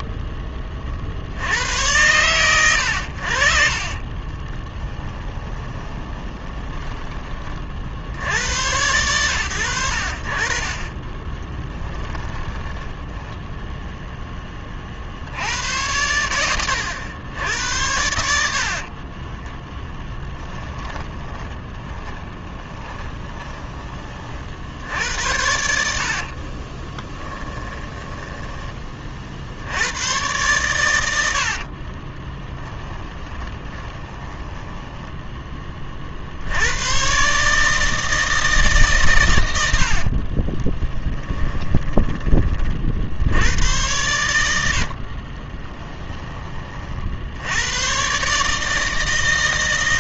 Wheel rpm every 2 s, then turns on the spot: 40, 90, 20, 20, 100, 30, 10, 40, 90, 50, 20, 20, 60, 20, 30, 100, 10, 10, 100, 140, 20, 50, 70, 50, 140.
4-8 12-14 18-24 26-28 32-36 40-42 44-46